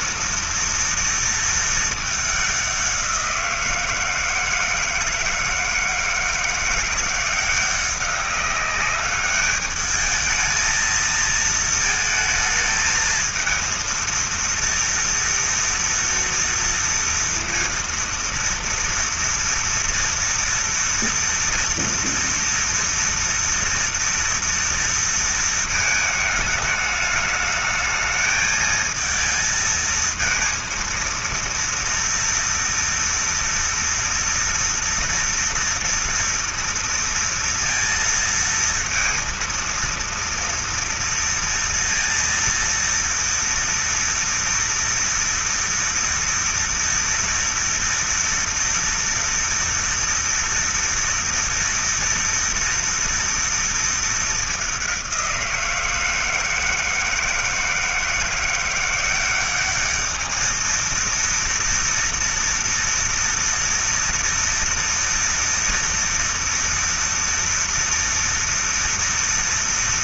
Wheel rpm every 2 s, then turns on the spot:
230, 190, 160, 170, 200, 220, 220, 230, 230, 230, 230, 230, 230, 210, 220, 230, 230, 230, 230, 230, 230, 230, 230, 230, 230, 230, 230, 200, 160, 180, 230, 240, 230, 230, 230.
none